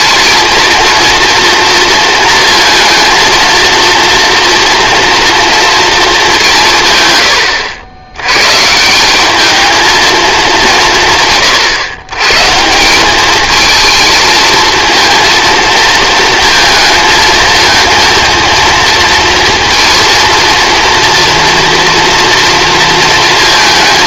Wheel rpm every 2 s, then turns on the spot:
230, 230, 240, 160, 140, 180, 160, 230, 230, 230, 230, 230.
none